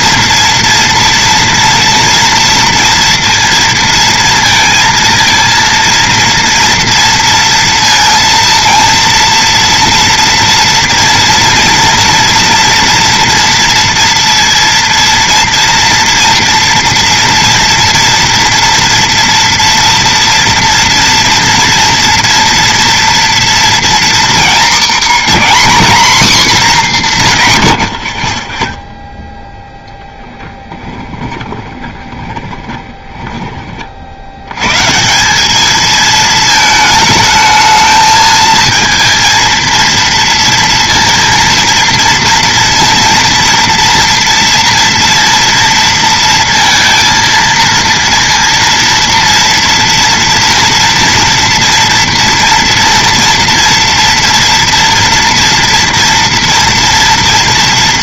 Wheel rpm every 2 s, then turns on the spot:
230, 230, 230, 230, 230, 230, 230, 230, 230, 240, 230, 230, 240, 230, 20, 10, 20, 100, 220, 220, 230, 230, 230, 230, 230, 230, 230, 230, 230.
30-34